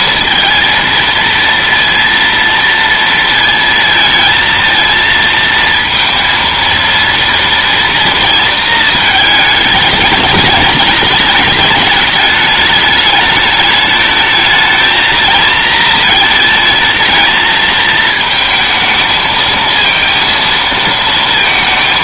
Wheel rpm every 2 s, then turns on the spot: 220, 230, 230, 230, 220, 210, 210, 220, 220, 220, 230.
none